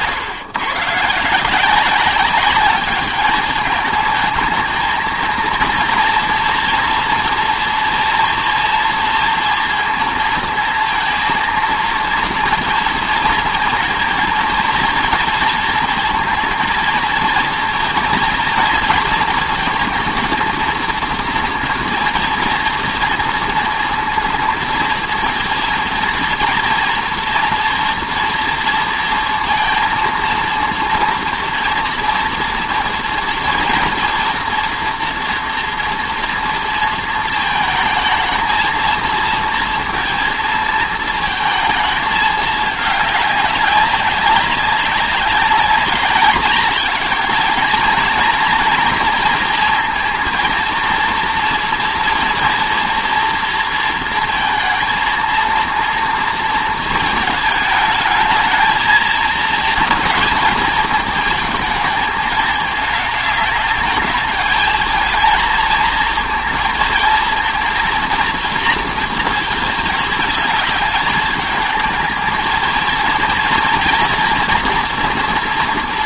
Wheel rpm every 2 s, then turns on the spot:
130, 200, 220, 230, 230, 230, 230, 230, 230, 230, 230, 230, 230, 230, 230, 230, 230, 230, 230, 230, 220, 210, 200, 200, 230, 230, 230, 230, 230, 220, 220, 220, 220, 230, 230, 210, 230, 230.
none